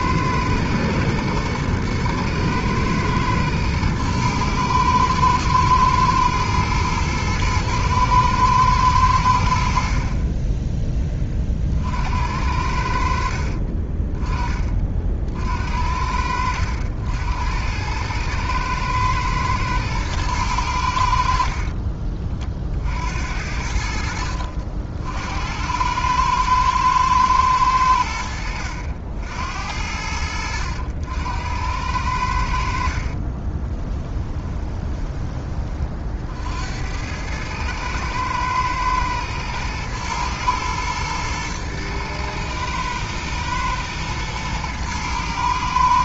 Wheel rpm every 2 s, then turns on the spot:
120, 110, 110, 110, 110, 10, 70, 30, 80, 110, 90, 50, 60, 110, 80, 80, 60, 20, 80, 110, 110, 110, 110.
32-36